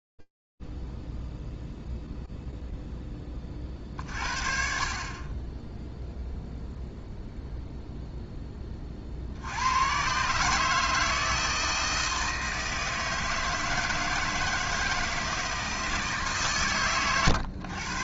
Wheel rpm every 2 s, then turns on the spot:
20, 20, 0, 70, 160, 160, 160, 110, 150.
none